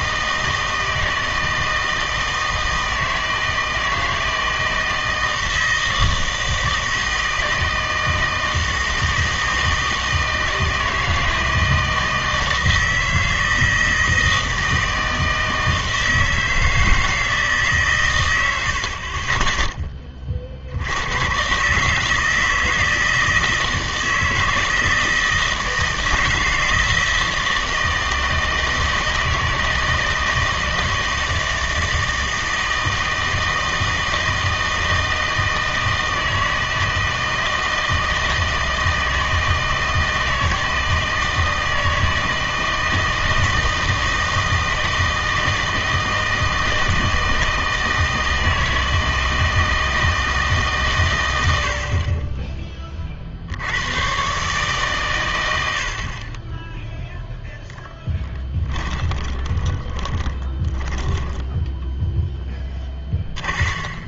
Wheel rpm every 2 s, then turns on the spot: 160, 160, 160, 160, 160, 160, 160, 160, 160, 90, 60, 160, 160, 160, 160, 160, 160, 160, 160, 160, 160, 160, 160, 160, 160, 150, 20, 130, 10, 20, 10, 10.
58-64